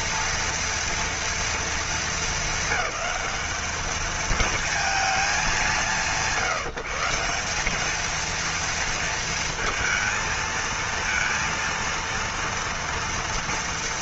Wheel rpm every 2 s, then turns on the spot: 230, 220, 220, 180, 230, 230, 230.
none